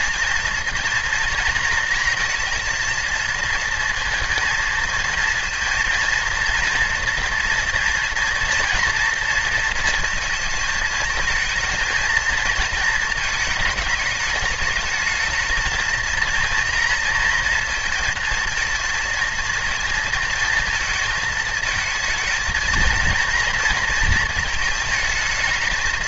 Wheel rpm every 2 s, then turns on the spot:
230, 230, 230, 230, 230, 220, 230, 220, 230, 230, 220, 230, 220.
none